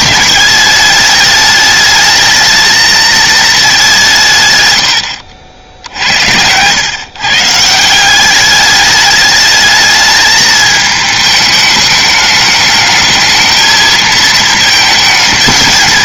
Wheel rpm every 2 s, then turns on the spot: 210, 220, 110, 100, 200, 220, 210, 220.
none